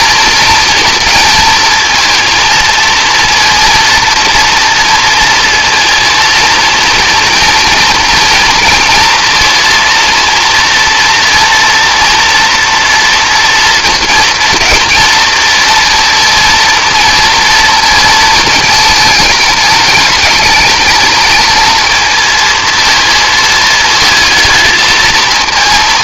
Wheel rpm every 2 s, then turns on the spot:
230, 230, 230, 230, 230, 230, 230, 230, 230, 220, 220, 230, 220.
none